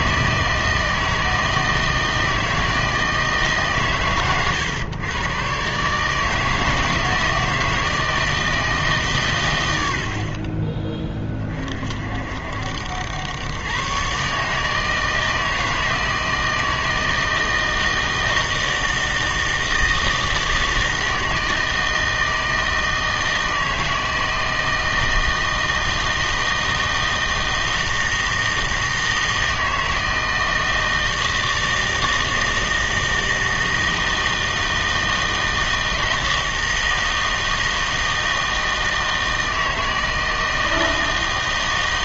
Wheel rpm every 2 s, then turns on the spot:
160, 160, 110, 160, 160, 30, 70, 150, 160, 160, 160, 160, 160, 160, 160, 160, 160, 160, 160, 160, 160.
none